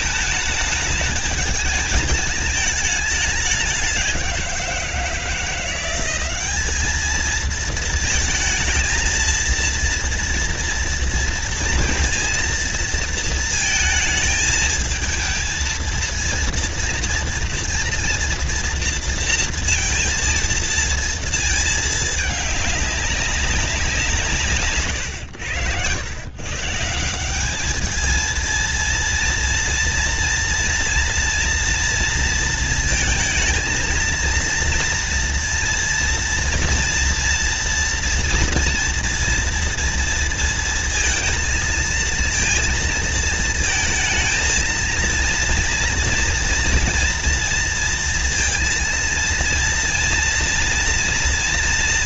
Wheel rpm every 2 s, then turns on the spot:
210, 210, 170, 210, 230, 230, 230, 220, 230, 230, 230, 200, 120, 180, 230, 230, 230, 230, 240, 230, 230, 230, 230, 230, 230, 230.
none